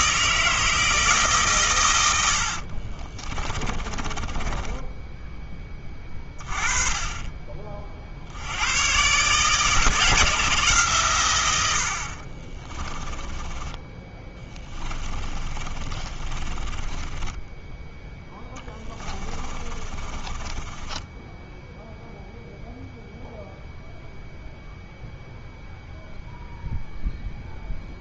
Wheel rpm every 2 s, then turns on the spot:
160, 40, 10, 20, 120, 140, 20, 20, 20, 10, 10, 0, 0, 0.
2-6 12-22